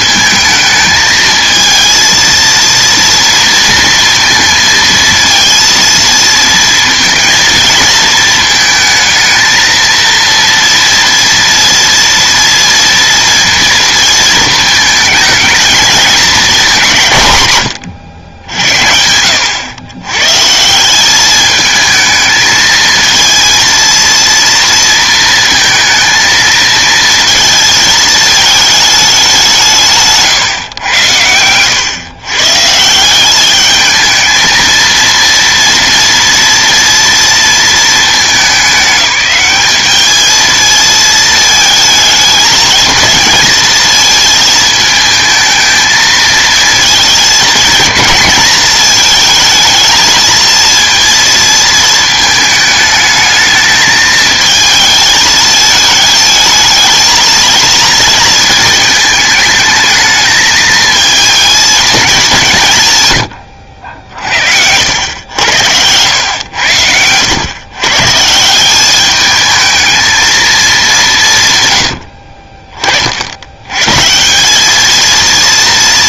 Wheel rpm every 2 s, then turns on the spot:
220, 230, 230, 230, 220, 230, 230, 220, 200, 80, 160, 220, 230, 230, 220, 120, 150, 230, 230, 200, 220, 220, 220, 220, 220, 230, 220, 220, 220, 220, 220, 170, 60, 100, 190, 220, 50, 200.
none